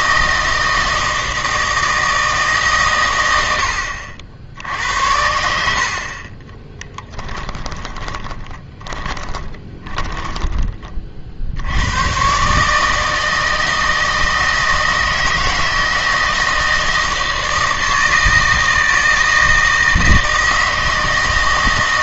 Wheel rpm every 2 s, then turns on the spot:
160, 130, 80, 10, 20, 30, 150, 160, 160, 160, 160.
6-10